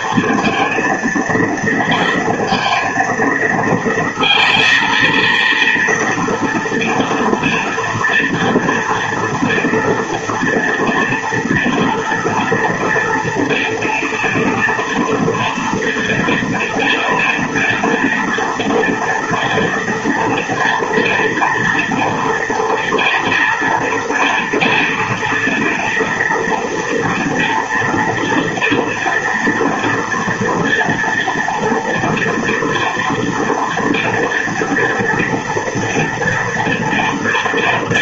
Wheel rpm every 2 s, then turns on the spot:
230, 230, 230, 240, 230, 230, 230, 230, 230, 230, 230, 230, 230, 230, 240, 230, 240, 230, 230.
none